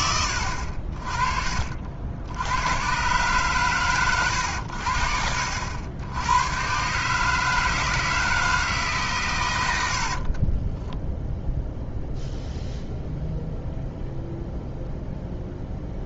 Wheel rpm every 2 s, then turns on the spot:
70, 90, 100, 110, 160, 20, 0, 0.
10-12